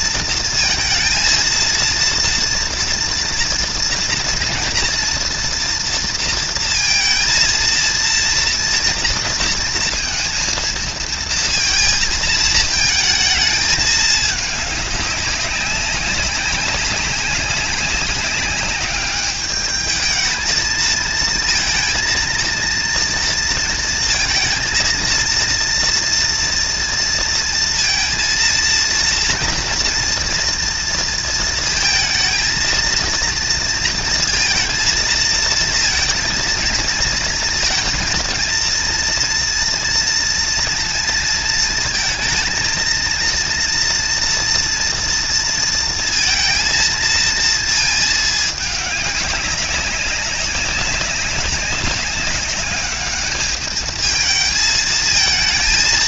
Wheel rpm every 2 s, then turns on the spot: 230, 230, 230, 230, 230, 230, 220, 200, 200, 200, 230, 230, 230, 230, 230, 230, 230, 230, 230, 230, 230, 230, 240, 230, 210, 200, 200, 220.
none